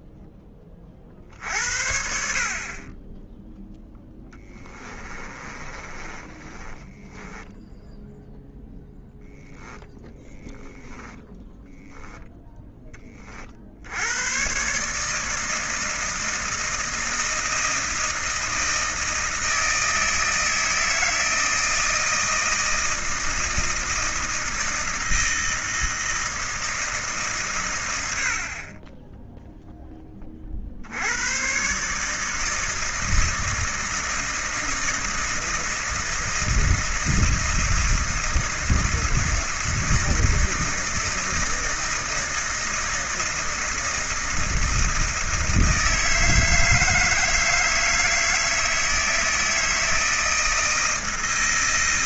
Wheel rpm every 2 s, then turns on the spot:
30, 40, 20, 10, 10, 10, 10, 130, 160, 160, 160, 160, 160, 160, 30, 60, 160, 160, 160, 160, 160, 160, 160, 160, 160, 160.
4-8 10-12